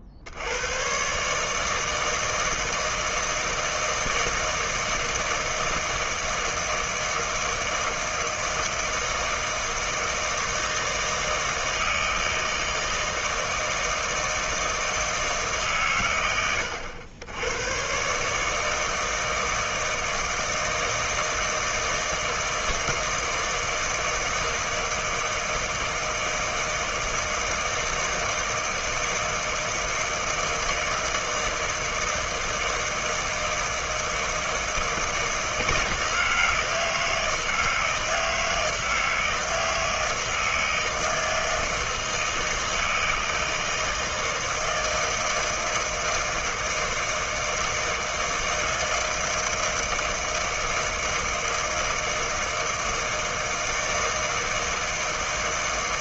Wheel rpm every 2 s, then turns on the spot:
60, 160, 160, 160, 160, 160, 160, 160, 100, 150, 160, 160, 160, 160, 160, 160, 160, 160, 160, 160, 160, 160, 160, 160, 160, 160, 160, 160.
none